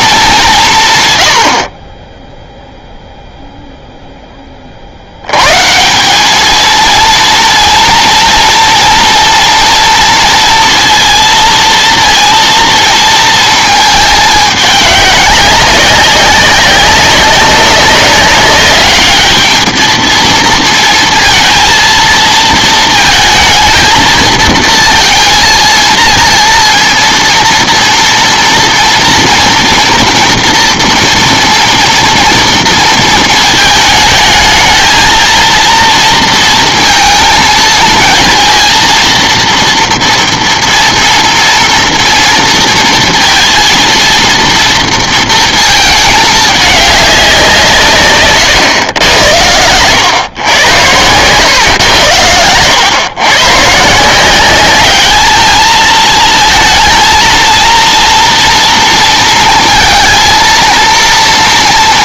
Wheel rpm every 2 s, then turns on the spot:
170, 0, 30, 220, 230, 230, 230, 200, 200, 200, 230, 230, 230, 230, 230, 230, 230, 220, 230, 230, 230, 230, 230, 200, 130, 100, 110, 200, 230, 230, 230.
none